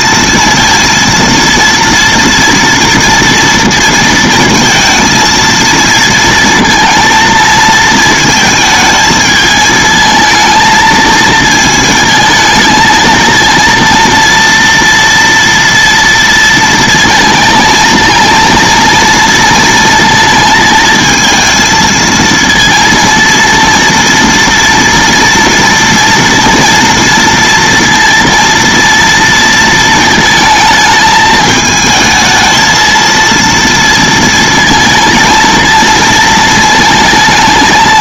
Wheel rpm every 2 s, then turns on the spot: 230, 230, 220, 230, 220, 220, 220, 230, 230, 230, 230, 230, 230, 230, 230, 220, 220, 230, 220.
none